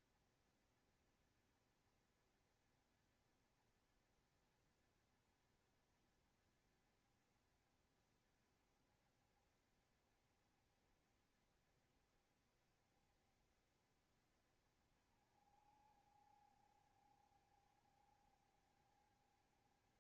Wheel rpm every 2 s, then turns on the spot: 70, 70, 60, 70, 70, 70, 70, 60, 70, 70.
none